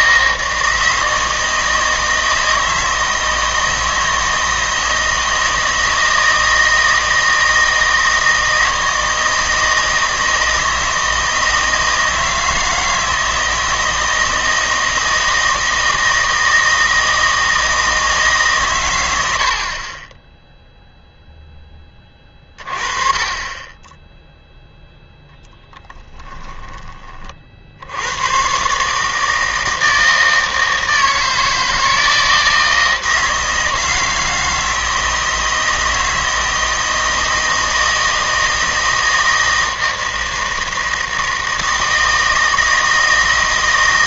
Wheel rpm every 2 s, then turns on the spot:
160, 160, 160, 160, 160, 160, 160, 160, 160, 140, 0, 30, 0, 10, 130, 160, 160, 160, 160, 160, 160, 160.
none